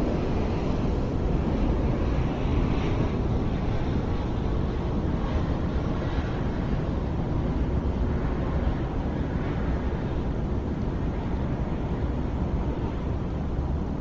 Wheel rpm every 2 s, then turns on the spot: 0, 0, 0, 0, 0, 0, 0.
none